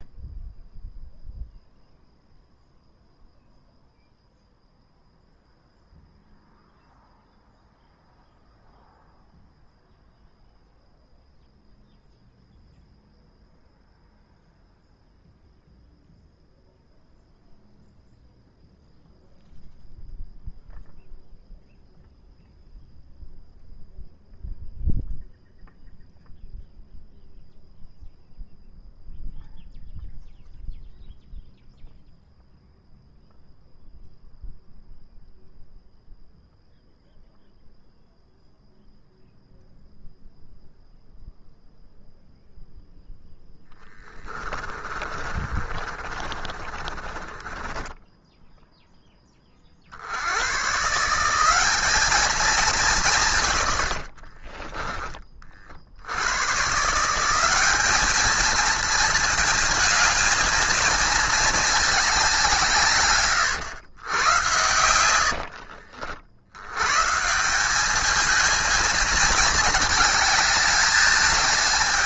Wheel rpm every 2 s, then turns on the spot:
0, 0, 0, 0, 0, 0, 0, 0, 0, 0, 0, 0, 0, 0, 0, 0, 0, 0, 0, 0, 0, 0, 20, 20, 10, 130, 200, 30, 150, 220, 220, 150, 100, 120, 220, 210.
44-48 54-56 64-66